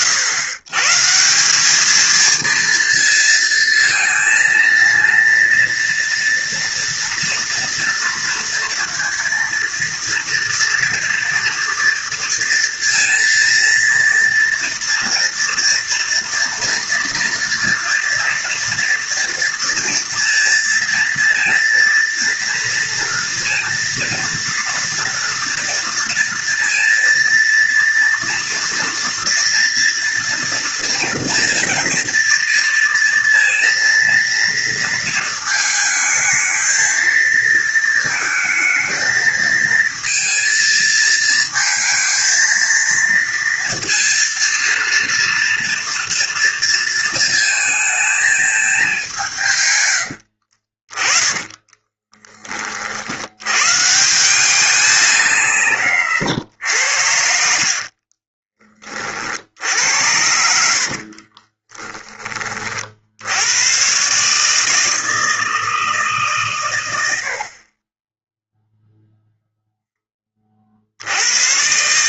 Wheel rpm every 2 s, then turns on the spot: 130, 230, 230, 230, 230, 230, 230, 230, 230, 240, 230, 230, 230, 230, 230, 230, 230, 230, 220, 220, 230, 230, 230, 230, 210, 50, 40, 200, 100, 30, 60, 40, 150, 110, 0, 50.
50-52 60-62